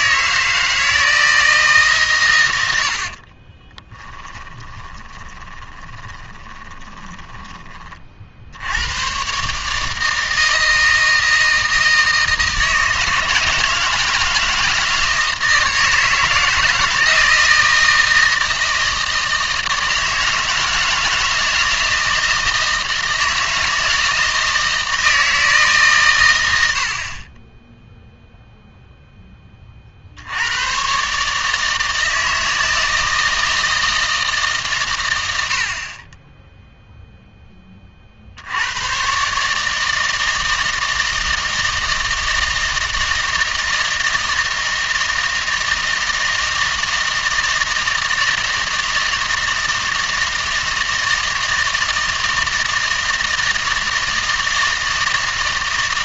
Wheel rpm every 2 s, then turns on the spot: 160, 90, 20, 20, 80, 160, 160, 160, 160, 160, 160, 160, 160, 90, 0, 110, 160, 130, 0, 90, 160, 160, 160, 160, 160, 160, 160, 160.
4-8